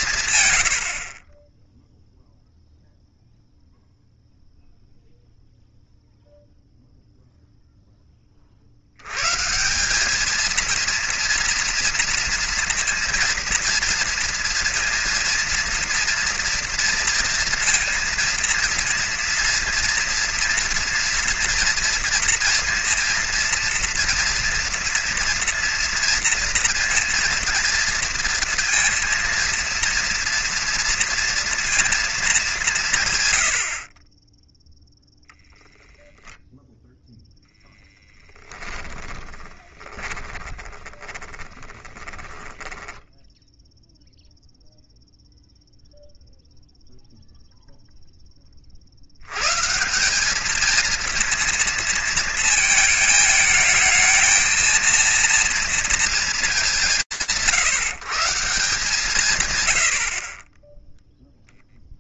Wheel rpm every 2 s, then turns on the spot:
40, 0, 0, 0, 80, 230, 230, 230, 230, 230, 230, 230, 230, 230, 230, 230, 160, 0, 0, 20, 30, 20, 0, 0, 10, 210, 230, 220, 190, 170, 40.
38-44